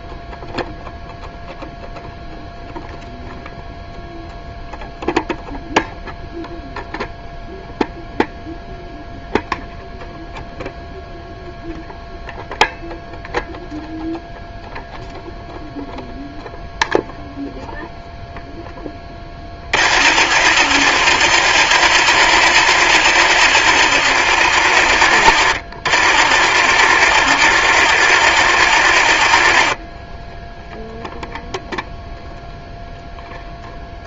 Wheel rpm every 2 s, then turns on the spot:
0, 0, 0, 0, 0, 0, 0, 0, 0, 10, 40, 40, 40, 40, 30, 0, 0.
none